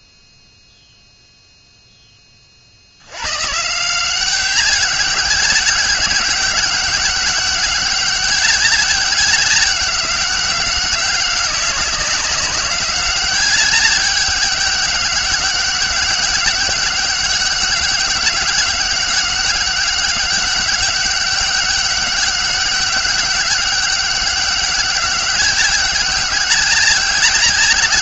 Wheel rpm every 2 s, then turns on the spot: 0, 70, 200, 200, 190, 200, 200, 200, 200, 200, 200, 200, 190, 190.
none